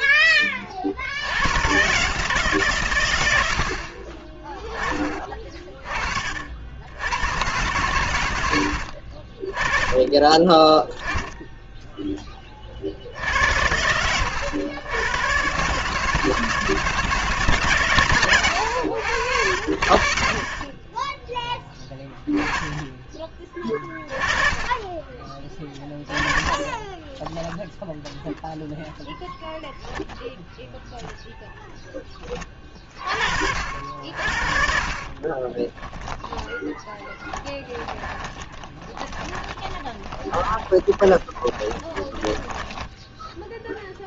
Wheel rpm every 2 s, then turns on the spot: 60, 110, 20, 80, 70, 10, 60, 100, 160, 100, 20, 20, 20, 20, 0, 0, 40, 40, 10, 20, 20, 0.
24-26 34-42